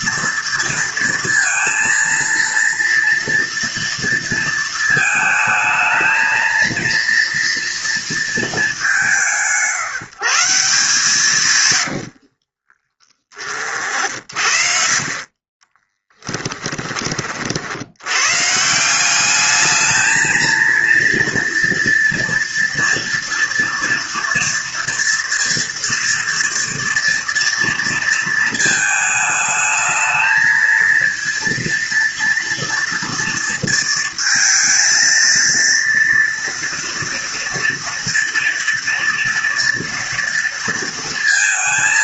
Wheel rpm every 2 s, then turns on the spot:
230, 230, 220, 230, 170, 160, 30, 50, 20, 160, 230, 230, 230, 230, 220, 230, 230, 230, 230, 230, 230.
12-16